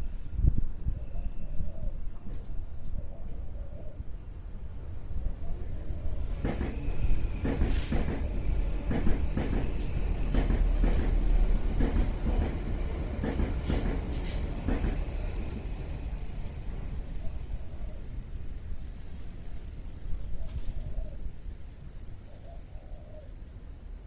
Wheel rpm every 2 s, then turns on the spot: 0, 0, 0, 0, 0, 0, 0, 0, 0, 0, 0, 0.
none